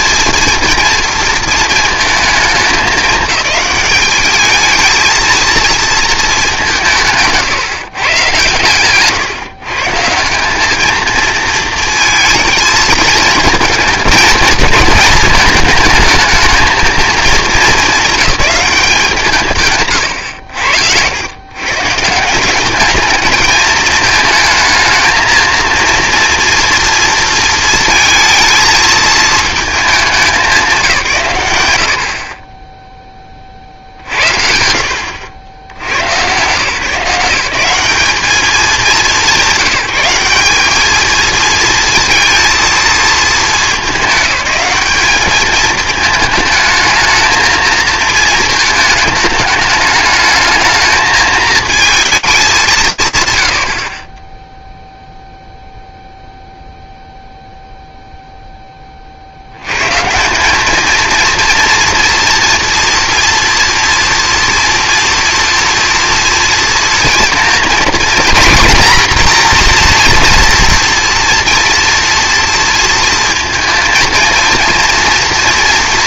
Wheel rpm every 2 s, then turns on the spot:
230, 210, 220, 180, 130, 210, 220, 220, 220, 200, 90, 200, 220, 230, 220, 170, 10, 60, 150, 200, 210, 230, 200, 220, 220, 220, 170, 0, 0, 30, 220, 230, 230, 230, 240, 230, 230, 230.
none